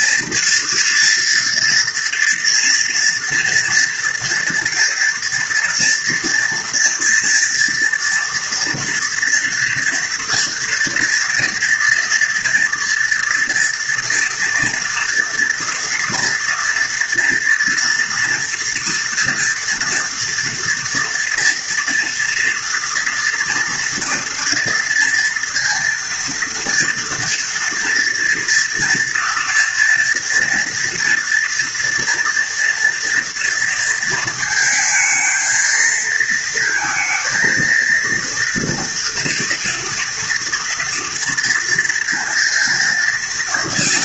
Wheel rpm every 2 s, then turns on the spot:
230, 240, 230, 230, 240, 240, 230, 230, 230, 230, 230, 230, 230, 230, 230, 240, 230, 220, 230, 230, 230, 230.
none